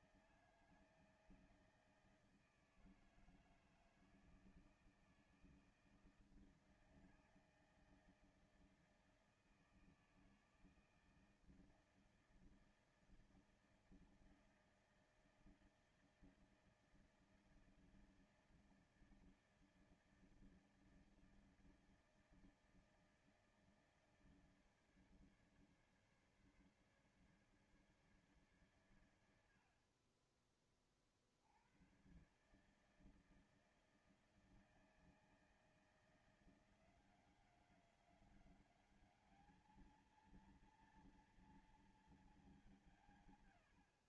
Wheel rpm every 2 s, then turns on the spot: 160, 160, 160, 160, 160, 160, 160, 160, 160, 160, 160, 160, 160, 150, 140, 40, 140, 160, 170, 190, 220, 210.
none